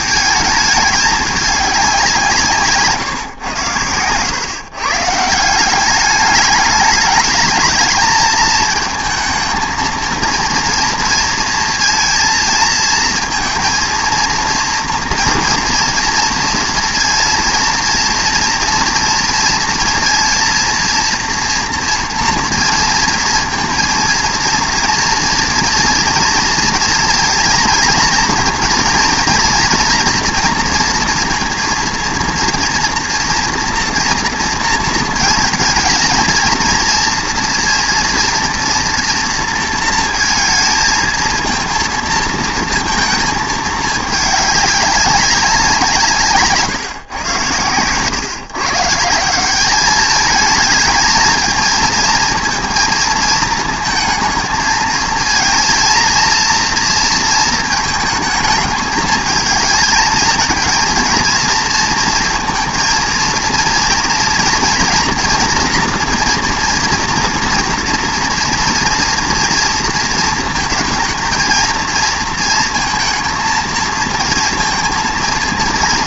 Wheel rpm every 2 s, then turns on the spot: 210, 150, 140, 210, 220, 230, 220, 230, 230, 230, 230, 230, 230, 230, 230, 240, 240, 230, 230, 230, 220, 230, 200, 140, 160, 220, 220, 220, 230, 220, 230, 230, 240, 240, 230, 230, 230, 230.
2-4